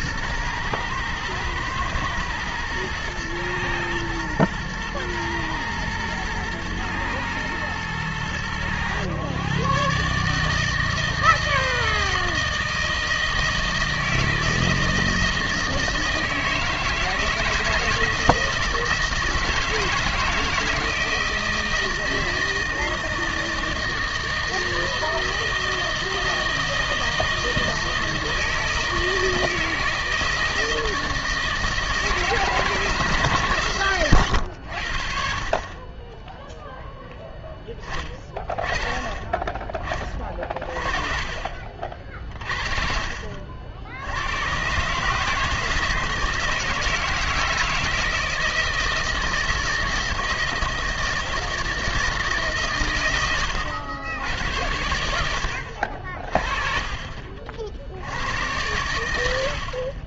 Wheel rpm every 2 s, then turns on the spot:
120, 110, 110, 110, 110, 160, 160, 160, 160, 170, 160, 160, 160, 160, 160, 160, 160, 90, 0, 20, 40, 40, 120, 160, 160, 160, 140, 100, 40, 100.
40-42